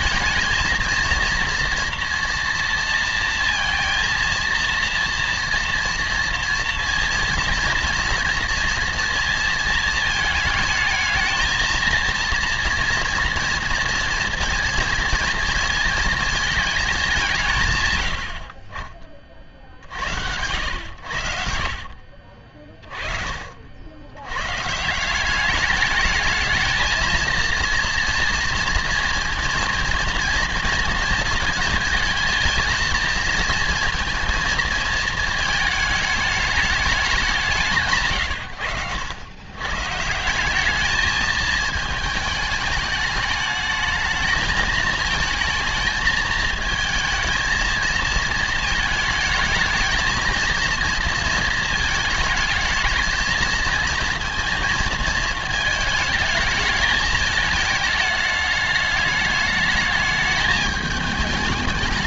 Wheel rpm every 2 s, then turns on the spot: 220, 240, 230, 230, 230, 220, 230, 230, 220, 40, 90, 40, 130, 220, 230, 230, 230, 220, 210, 110, 200, 210, 220, 230, 220, 230, 220, 230, 220, 210, 210.
none